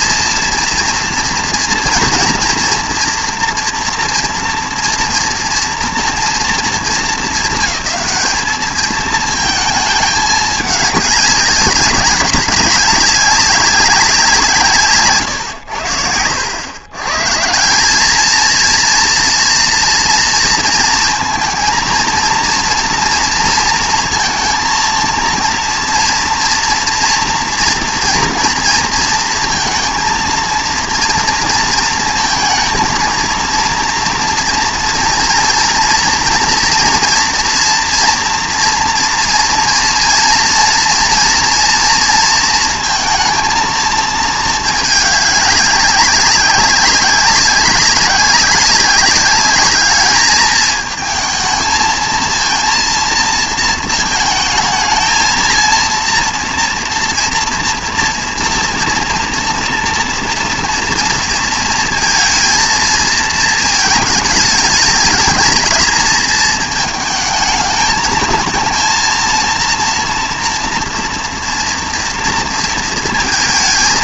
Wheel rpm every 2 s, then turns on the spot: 240, 230, 230, 230, 220, 210, 200, 160, 100, 230, 230, 230, 230, 230, 230, 230, 220, 230, 230, 230, 240, 230, 220, 190, 200, 220, 230, 220, 230, 240, 230, 230, 210, 220, 230, 230, 230.
none